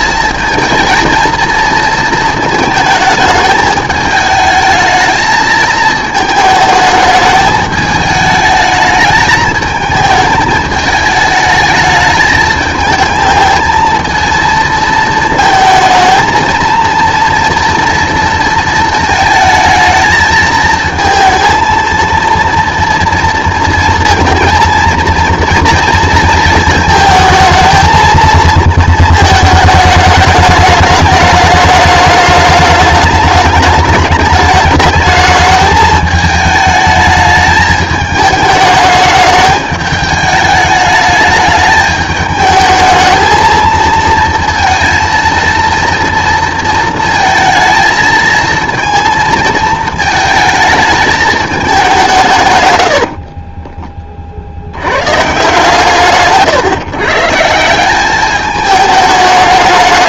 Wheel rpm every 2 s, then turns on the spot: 230, 220, 220, 220, 220, 220, 220, 220, 230, 220, 220, 240, 230, 220, 230, 210, 210, 210, 220, 210, 210, 220, 230, 230, 230, 220, 120, 90, 150, 210.
52-54